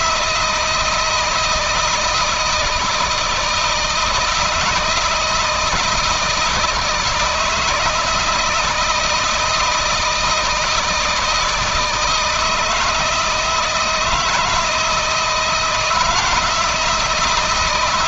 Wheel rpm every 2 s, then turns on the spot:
170, 160, 160, 160, 170, 160, 160, 160, 160.
none